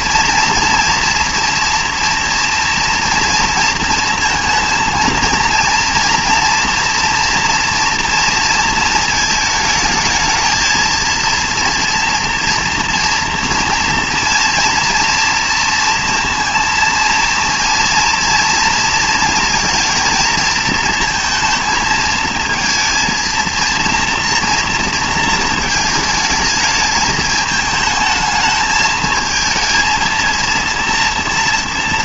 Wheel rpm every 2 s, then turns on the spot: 230, 230, 230, 230, 230, 230, 230, 230, 230, 230, 230, 230, 230, 220, 220, 230.
none